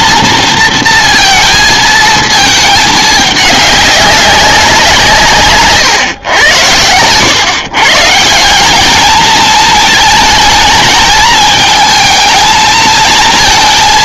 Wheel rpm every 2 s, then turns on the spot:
230, 220, 200, 120, 150, 220, 220.
none